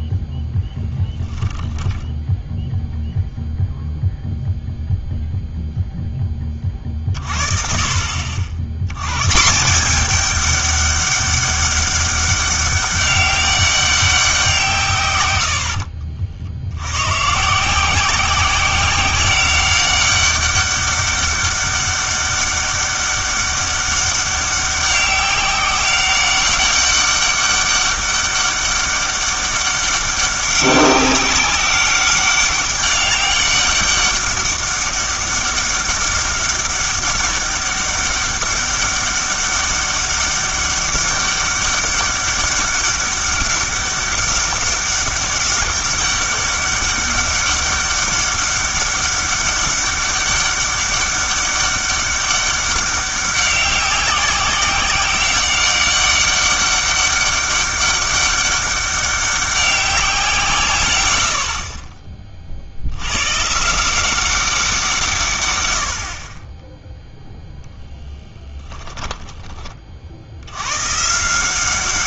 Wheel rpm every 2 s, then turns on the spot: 10, 0, 0, 30, 80, 200, 200, 160, 80, 180, 200, 200, 190, 200, 200, 190, 200, 200, 200, 200, 200, 200, 200, 200, 200, 200, 200, 190, 200, 200, 130, 60, 180, 10, 20, 110.
0-2 68-70